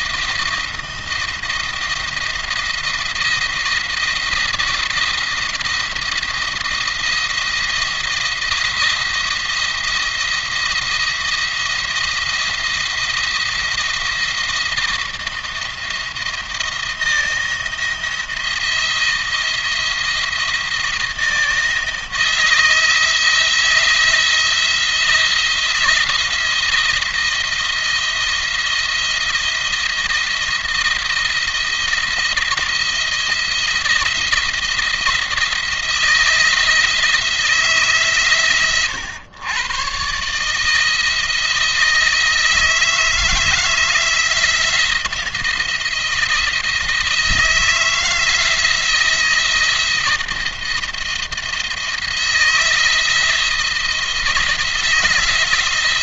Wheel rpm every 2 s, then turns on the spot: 170, 170, 170, 170, 170, 170, 170, 170, 160, 170, 170, 160, 170, 170, 170, 170, 170, 170, 160, 120, 150, 160, 170, 160, 160, 170, 160, 160.
none